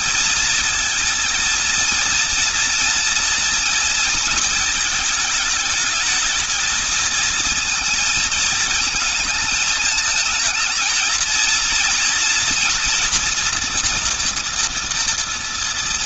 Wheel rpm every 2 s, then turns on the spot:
230, 230, 220, 220, 220, 220, 230, 230.
none